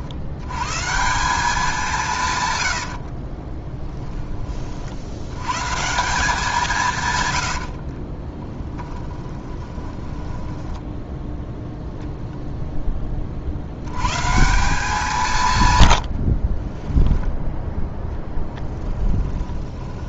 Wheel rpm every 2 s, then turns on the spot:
120, 110, 40, 170, 10, 10, 0, 180, 30, 10.
2-4 8-12 16-20